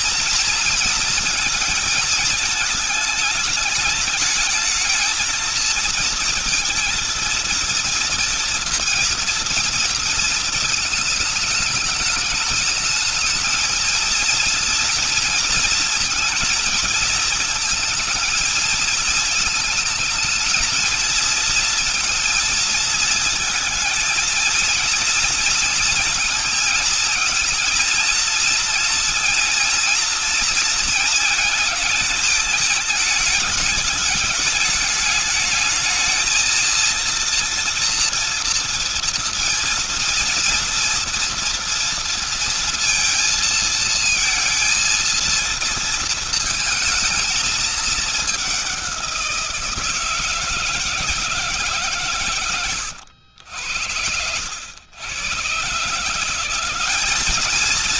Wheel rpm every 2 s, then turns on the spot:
230, 220, 210, 230, 230, 230, 220, 220, 230, 230, 220, 230, 230, 230, 230, 230, 220, 210, 220, 230, 230, 230, 230, 220, 200, 160, 130, 80, 170.
none